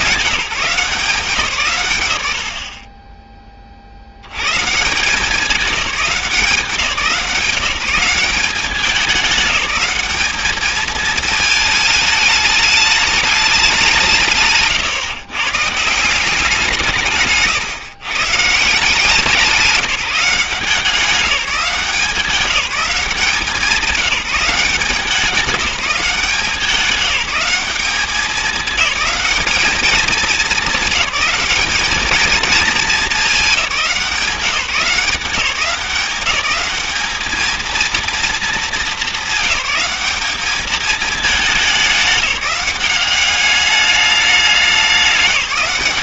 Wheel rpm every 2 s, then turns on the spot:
180, 50, 130, 170, 190, 210, 210, 160, 170, 150, 180, 190, 190, 180, 210, 200, 210, 180, 200, 220, 210, 200, 200.
none